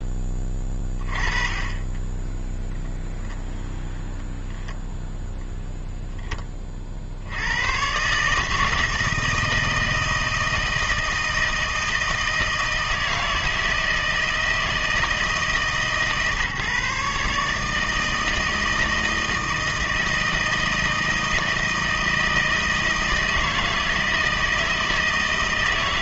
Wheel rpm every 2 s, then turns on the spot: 20, 0, 0, 20, 150, 160, 160, 160, 150, 160, 160, 160, 160.
none